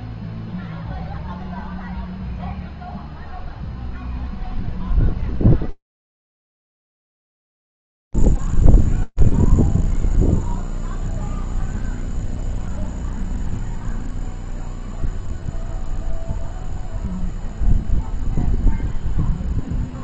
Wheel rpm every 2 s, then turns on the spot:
0, 0, 0, 0, 0, 0, 0, 0, 0, 0.
none